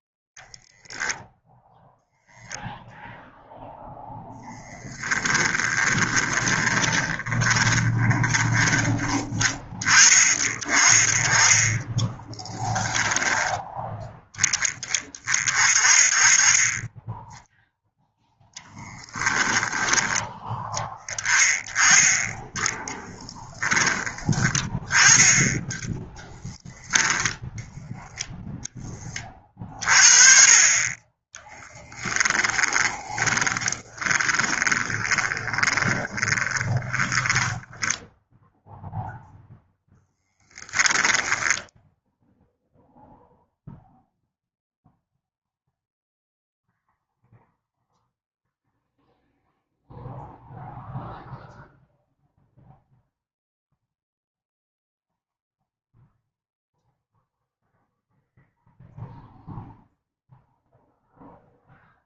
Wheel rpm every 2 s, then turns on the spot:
10, 0, 10, 20, 20, 30, 20, 20, 10, 10, 10, 10, 20, 10, 20, 20, 20, 10, 10, 0, 10, 0, 0, 0, 0, 0, 0, 0, 0, 0, 0.
4-8 12-14 18-20 22-24 32-38 40-42